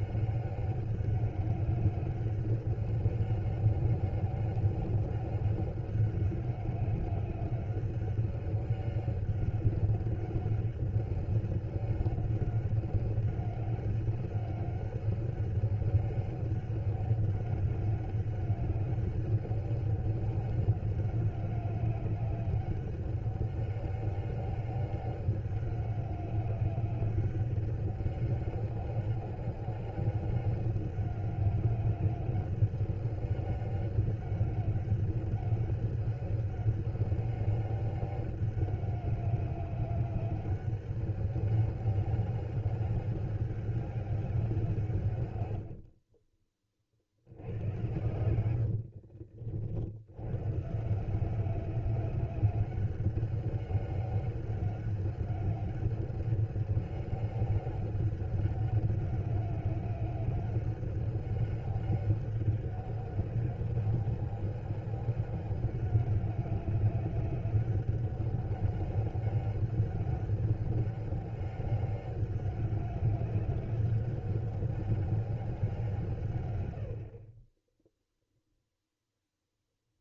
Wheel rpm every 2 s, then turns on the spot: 200, 190, 200, 200, 200, 200, 200, 200, 200, 190, 200, 200, 200, 200, 200, 200, 190, 200, 200, 200, 200, 200, 180, 40, 80, 140, 190, 200, 200, 200, 200, 200, 200, 200, 200, 200, 190, 190, 110, 0.
48-50